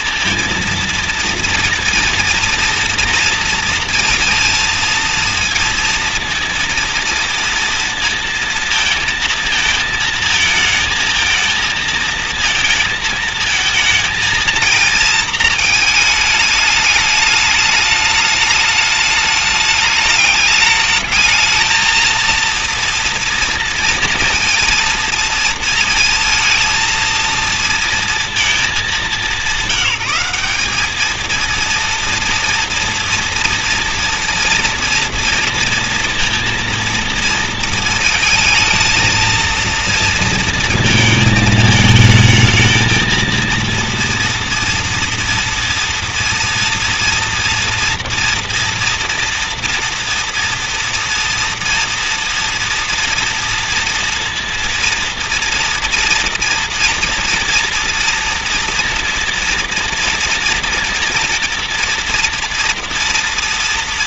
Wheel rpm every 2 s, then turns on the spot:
230, 230, 230, 230, 230, 220, 230, 230, 210, 210, 220, 230, 230, 220, 220, 200, 230, 230, 230, 220, 230, 220, 230, 230, 240, 230, 230, 230, 240, 240, 230, 230.
none